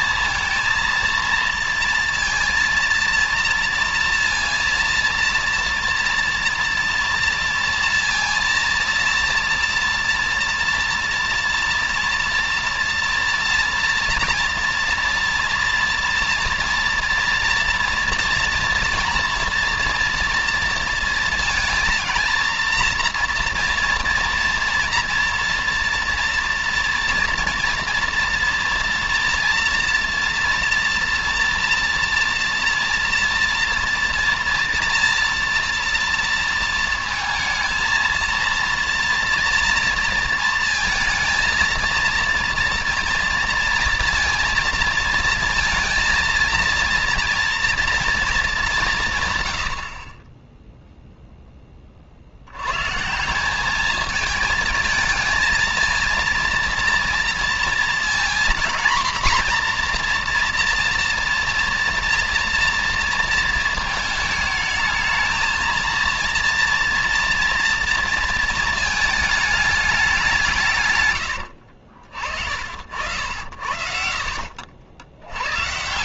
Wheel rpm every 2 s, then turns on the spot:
220, 230, 230, 230, 230, 230, 230, 230, 230, 230, 230, 230, 230, 230, 230, 230, 230, 230, 230, 230, 230, 230, 230, 230, 220, 20, 70, 220, 230, 240, 240, 240, 220, 230, 230, 180, 40, 70.
74-76